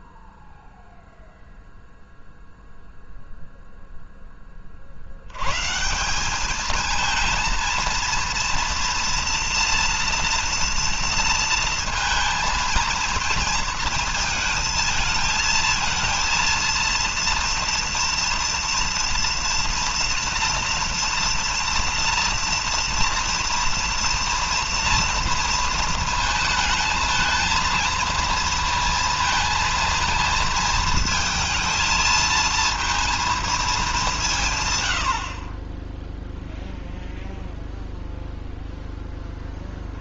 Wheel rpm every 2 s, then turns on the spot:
0, 0, 70, 220, 230, 230, 230, 220, 230, 230, 230, 230, 230, 220, 230, 220, 230, 90, 0, 10.
none